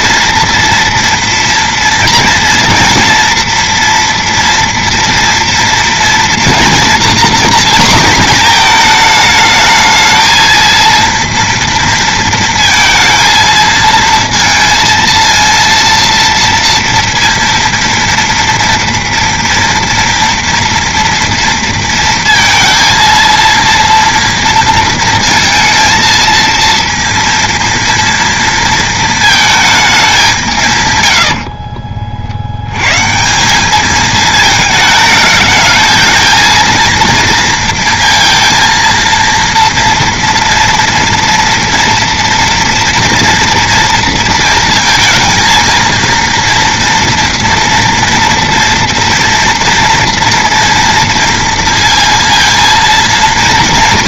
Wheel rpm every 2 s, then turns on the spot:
230, 240, 230, 240, 220, 230, 230, 230, 230, 230, 240, 230, 230, 230, 230, 130, 110, 220, 230, 230, 230, 230, 230, 230, 230, 230, 230.
none